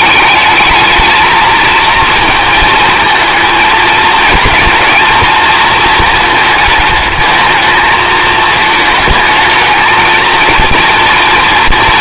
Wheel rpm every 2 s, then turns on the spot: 220, 230, 220, 220, 220, 230.
none